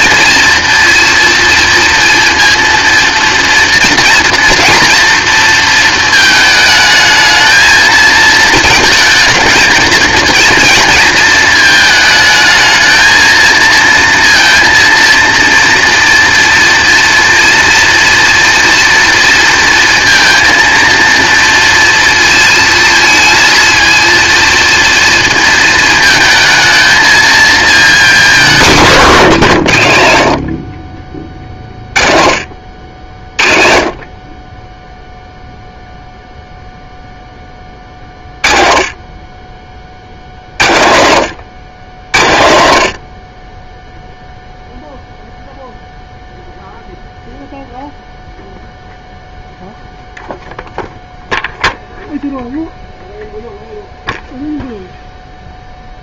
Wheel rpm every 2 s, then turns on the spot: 230, 230, 240, 220, 220, 230, 230, 230, 230, 230, 230, 230, 230, 220, 160, 40, 60, 0, 0, 30, 90, 60, 0, 0, 0, 0, 0, 0.
none